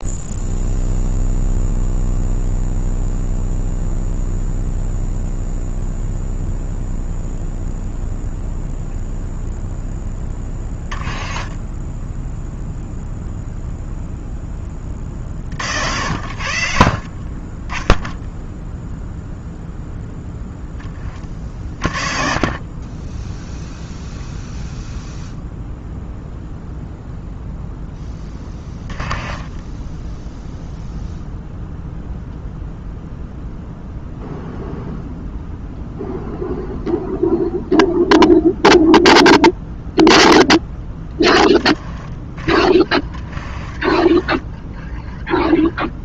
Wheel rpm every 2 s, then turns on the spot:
0, 0, 0, 0, 0, 20, 0, 20, 60, 0, 10, 30, 0, 0, 10, 0, 0, 0, 0, 0, 0, 20, 10.
none